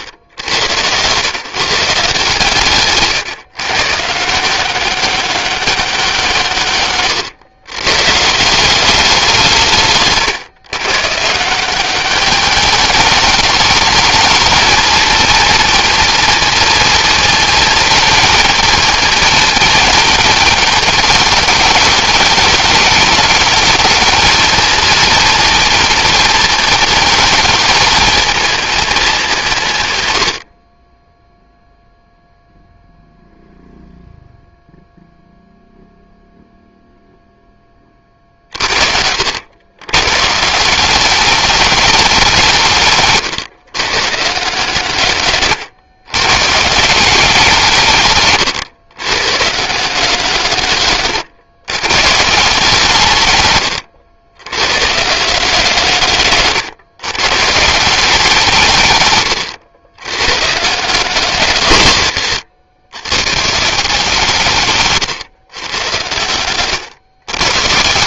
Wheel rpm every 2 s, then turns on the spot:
150, 140, 190, 120, 150, 170, 210, 230, 220, 220, 210, 220, 230, 210, 170, 0, 0, 0, 20, 90, 210, 120, 120, 170, 150, 120, 100, 150, 150, 110, 140, 160, 120, 140.
58-60